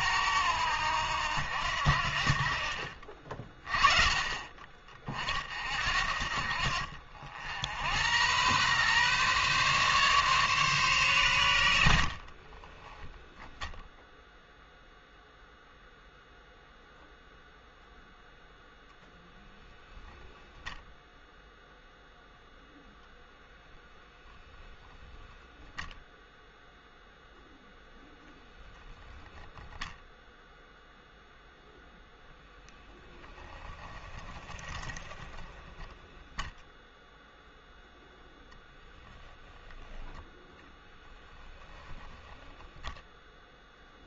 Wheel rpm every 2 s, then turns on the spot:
90, 40, 40, 50, 120, 130, 20, 0, 0, 10, 10, 0, 0, 0, 0, 0, 10, 20, 0, 0, 10, 0.
12-14 34-36 40-42